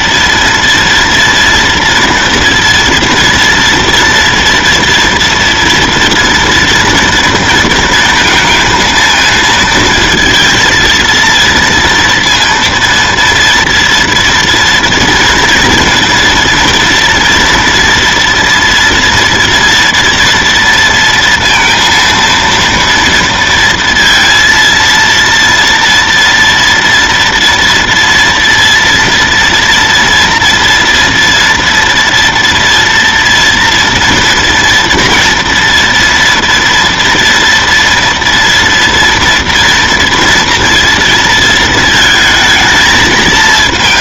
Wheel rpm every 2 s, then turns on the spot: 230, 230, 240, 230, 230, 230, 230, 230, 230, 230, 230, 230, 230, 230, 230, 230, 230, 240, 230, 240, 230, 220.
none